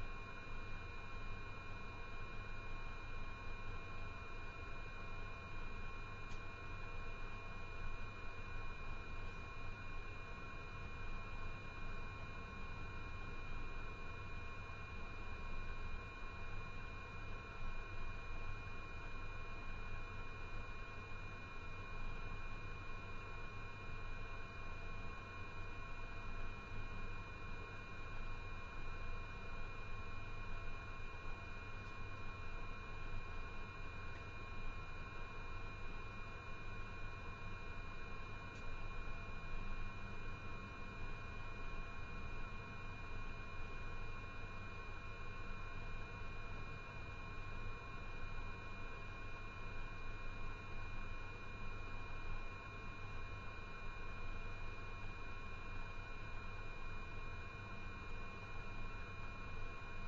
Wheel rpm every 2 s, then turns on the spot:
0, 0, 0, 0, 0, 0, 0, 0, 0, 0, 0, 0, 0, 0, 0, 0, 0, 0, 0, 0, 0, 0, 0, 0, 0, 0, 0, 0, 0, 0.
none